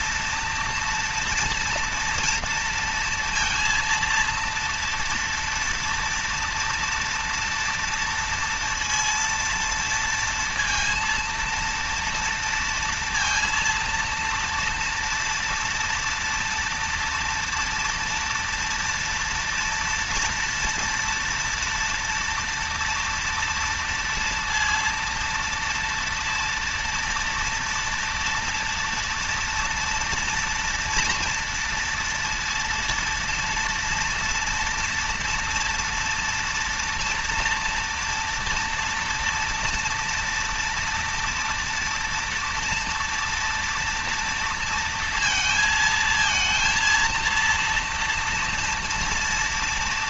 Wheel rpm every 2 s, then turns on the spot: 230, 230, 230, 240, 230, 230, 230, 230, 230, 240, 240, 230, 230, 230, 230, 230, 230, 230, 230, 230, 230, 230, 230, 230, 230.
none